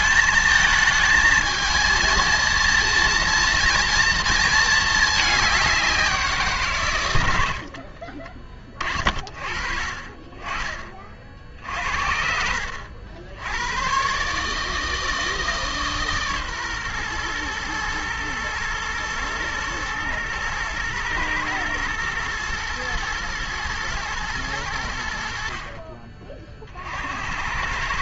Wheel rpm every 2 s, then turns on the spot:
220, 230, 220, 140, 30, 30, 80, 150, 130, 120, 110, 110, 90, 50.
none